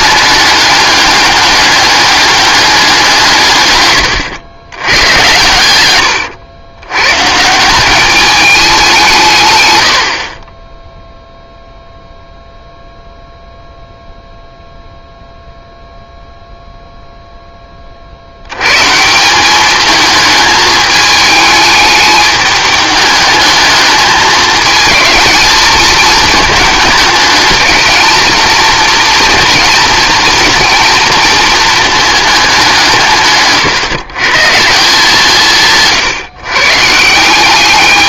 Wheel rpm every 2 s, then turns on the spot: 210, 200, 100, 110, 200, 10, 0, 0, 0, 100, 210, 210, 210, 220, 230, 230, 190, 160, 140.
none